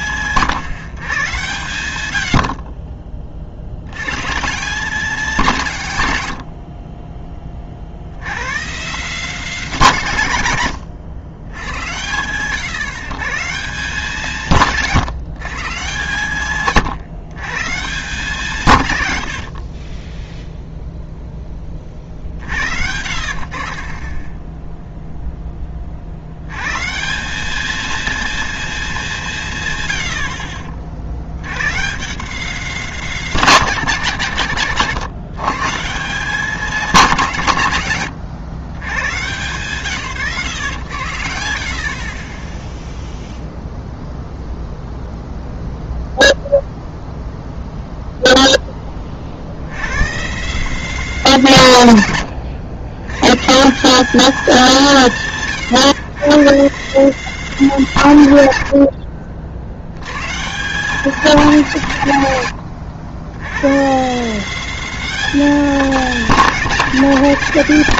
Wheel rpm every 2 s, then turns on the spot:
130, 50, 180, 70, 140, 120, 110, 160, 130, 150, 0, 70, 10, 110, 230, 40, 190, 130, 200, 120, 120, 10, 0, 0, 10, 180, 110, 180, 170, 90, 170, 100, 200, 190.
2-4 6-8 62-64